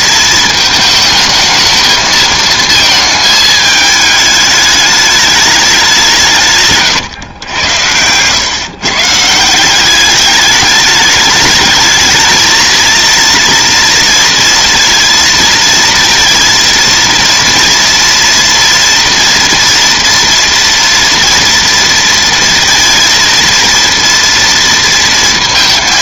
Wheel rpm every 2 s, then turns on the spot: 220, 220, 210, 140, 130, 200, 230, 230, 230, 230, 240, 230, 230.
none